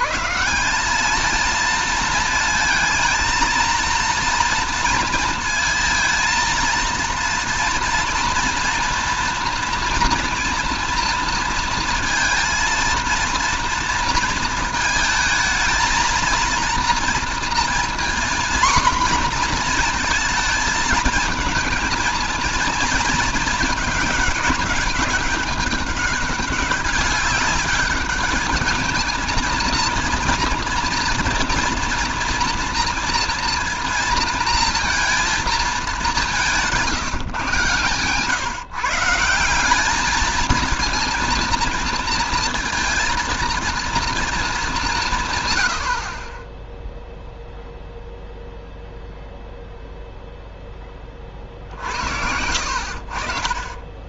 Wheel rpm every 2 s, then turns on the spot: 180, 230, 230, 230, 230, 230, 230, 230, 230, 250, 220, 230, 200, 200, 220, 230, 230, 230, 180, 140, 230, 230, 190, 10, 0, 10, 70.
none